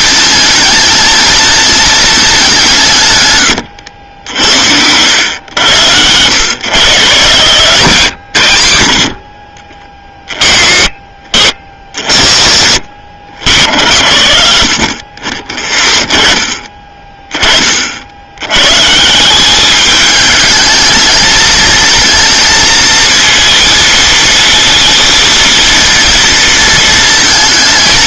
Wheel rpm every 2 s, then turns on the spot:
220, 170, 80, 120, 70, 20, 50, 40, 20, 130, 210, 230, 230, 230.
none